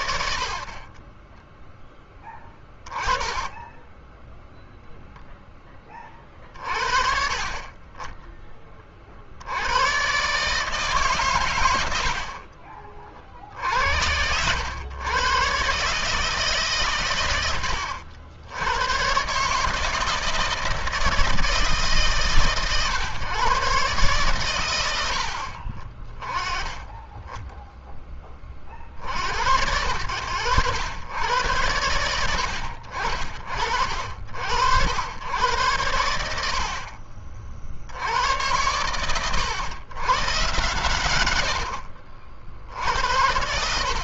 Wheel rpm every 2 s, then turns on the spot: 20, 20, 0, 40, 50, 140, 50, 110, 130, 120, 160, 130, 80, 10, 60, 100, 60, 100, 40, 110, 120, 70.
2-4 36-38